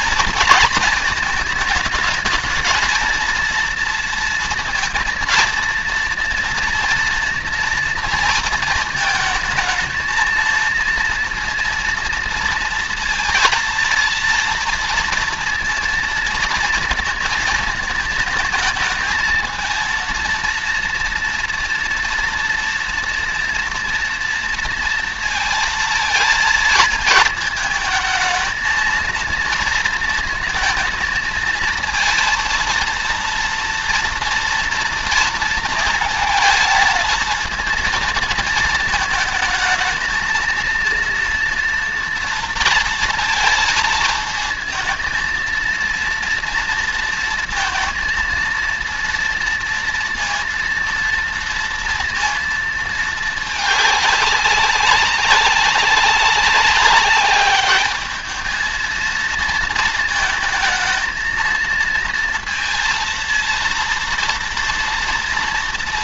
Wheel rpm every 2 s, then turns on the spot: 230, 220, 230, 230, 230, 230, 230, 230, 230, 220, 230, 240, 230, 230, 220, 230, 230, 230, 230, 220, 230, 230, 220, 230, 230, 230, 230, 200, 190, 220, 220, 230, 230.
none